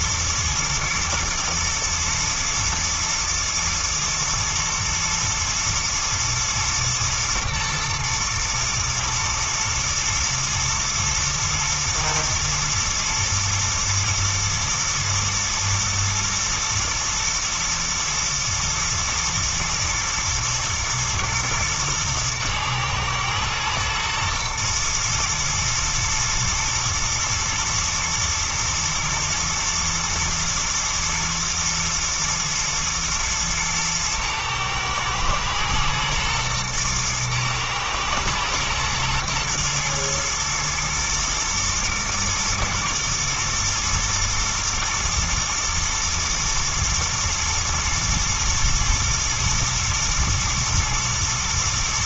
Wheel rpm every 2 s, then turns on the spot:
120, 120, 120, 110, 120, 110, 110, 110, 110, 120, 120, 110, 110, 110, 120, 110, 110, 110, 110, 110, 120, 120, 110, 120, 120, 110.
none